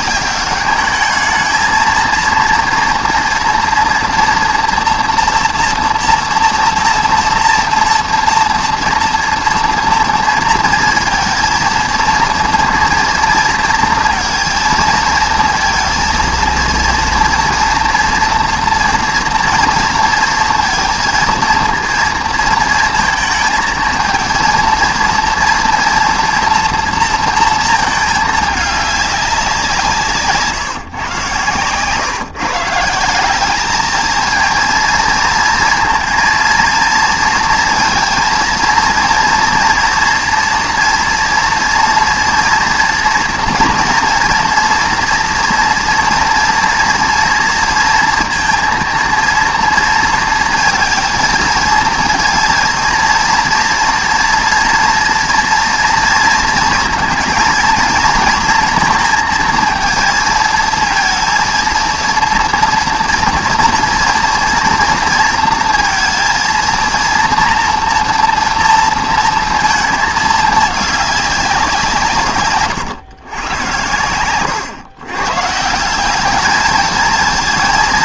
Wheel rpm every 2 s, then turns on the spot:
200, 240, 240, 230, 230, 230, 230, 230, 230, 230, 230, 230, 230, 230, 210, 150, 160, 230, 230, 230, 240, 240, 240, 240, 230, 230, 230, 230, 230, 230, 230, 230, 230, 230, 230, 210, 120, 120, 220.
none